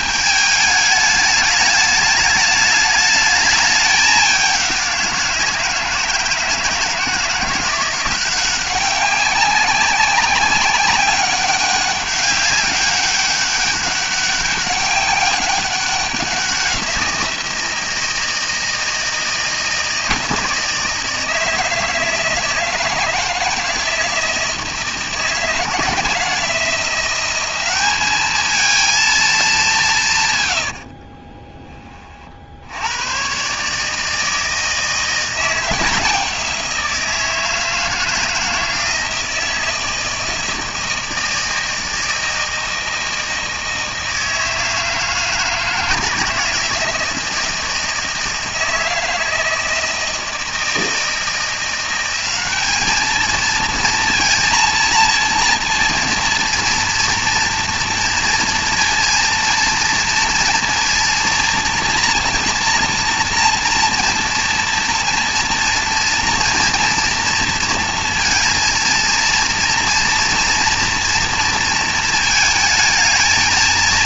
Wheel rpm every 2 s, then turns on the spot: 210, 210, 190, 160, 180, 190, 200, 200, 180, 160, 160, 160, 160, 170, 220, 110, 70, 160, 170, 160, 160, 160, 160, 160, 160, 170, 200, 230, 230, 230, 230, 230, 230, 230, 230, 230, 220.
30-32